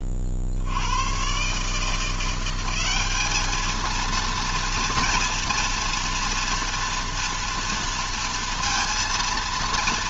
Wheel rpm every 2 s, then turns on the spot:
90, 190, 230, 230, 230.
none